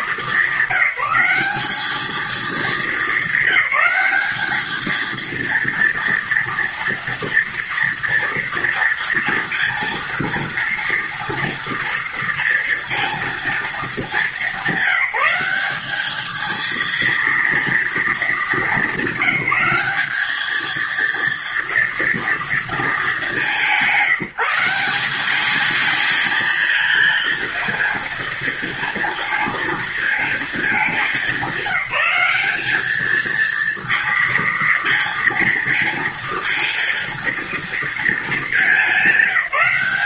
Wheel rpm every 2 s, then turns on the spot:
200, 220, 210, 230, 240, 230, 230, 200, 220, 220, 210, 230, 170, 230, 230, 220, 210, 230, 230, 210.
none